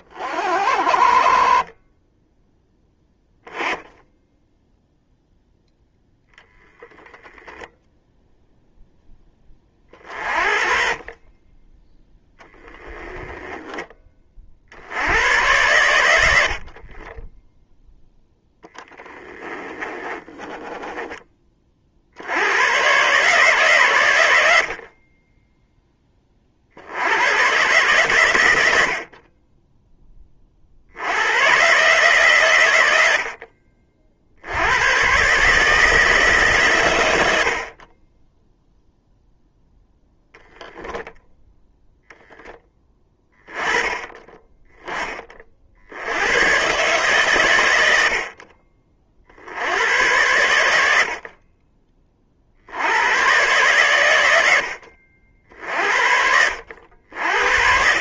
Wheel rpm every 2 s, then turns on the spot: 40, 0, 0, 0, 0, 40, 10, 20, 50, 10, 10, 110, 50, 70, 80, 70, 100, 100, 120, 0, 0, 10, 10, 120, 40, 80, 80, 70, 60.
18-22